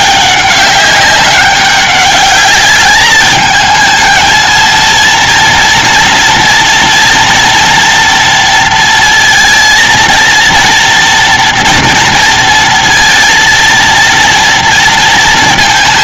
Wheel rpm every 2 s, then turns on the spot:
190, 210, 230, 240, 230, 230, 230, 230.
none